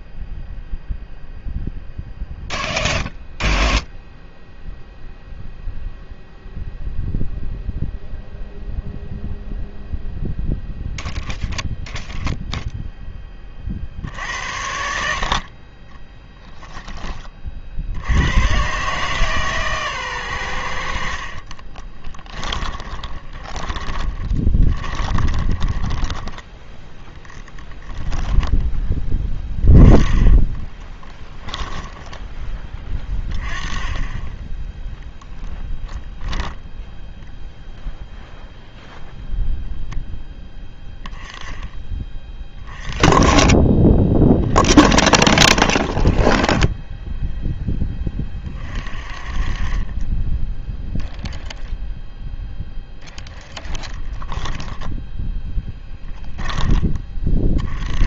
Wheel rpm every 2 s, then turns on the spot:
0, 0, 0, 0, 0, 0, 0, 80, 10, 130, 80, 20, 20, 10, 10, 20, 20, 10, 0, 0, 10, 20, 30, 20, 30, 0, 0, 10, 10.
22-26 30-32 54-56